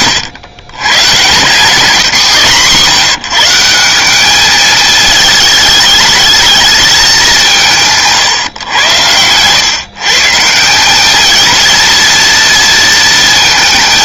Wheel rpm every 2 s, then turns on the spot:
130, 150, 210, 220, 120, 180, 230.
none